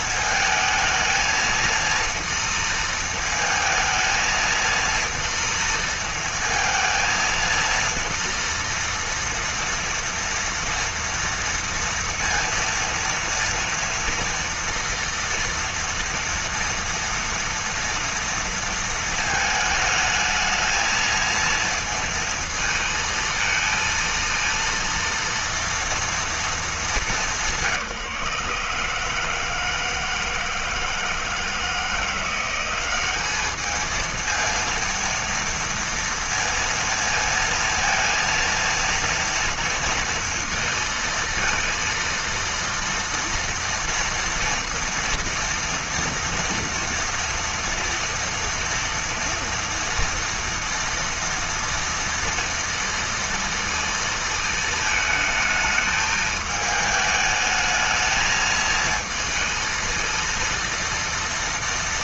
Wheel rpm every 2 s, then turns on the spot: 220, 230, 230, 230, 230, 230, 230, 240, 230, 230, 220, 230, 230, 200, 150, 160, 190, 230, 230, 230, 230, 230, 230, 230, 230, 230, 230, 220, 210, 220, 230.
none